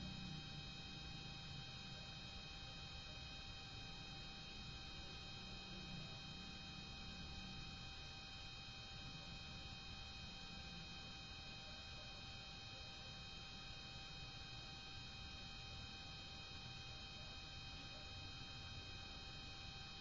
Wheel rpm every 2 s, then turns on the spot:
0, 0, 0, 0, 0, 0, 0, 0, 0, 0.
none